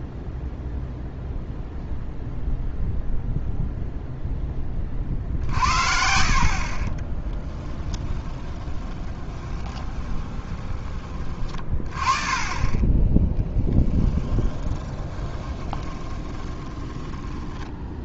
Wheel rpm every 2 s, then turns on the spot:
0, 0, 20, 40, 20, 20, 20, 10, 10.
8-10 14-18